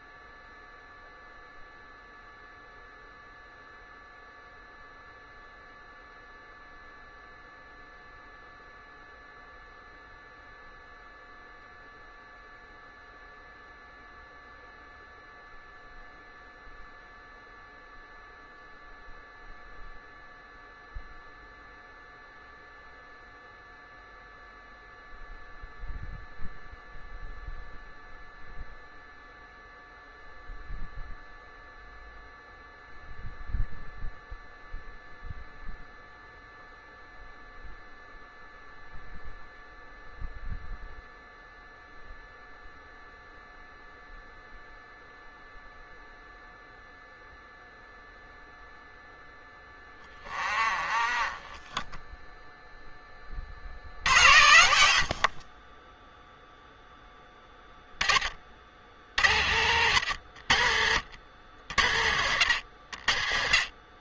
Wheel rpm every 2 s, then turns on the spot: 0, 0, 0, 0, 0, 0, 0, 0, 0, 0, 0, 0, 0, 0, 0, 0, 0, 0, 0, 0, 0, 0, 0, 0, 0, 20, 10, 50, 10, 60, 70, 60.
none